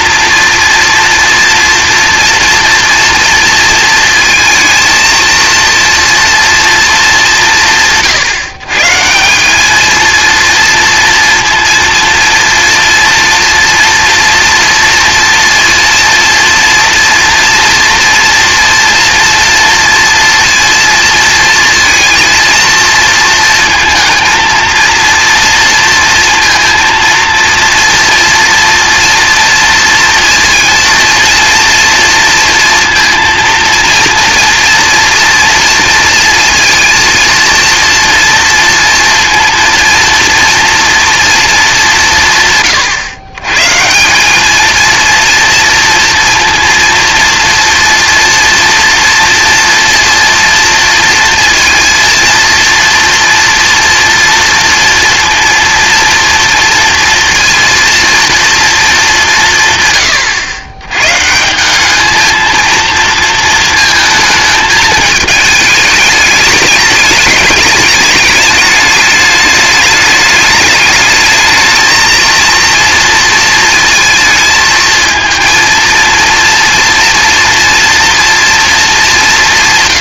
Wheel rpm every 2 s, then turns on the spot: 230, 230, 230, 230, 150, 230, 230, 230, 230, 230, 230, 230, 220, 230, 230, 230, 230, 240, 230, 230, 230, 130, 220, 230, 230, 230, 230, 230, 230, 230, 110, 230, 220, 210, 220, 210, 230, 220, 230, 220.
none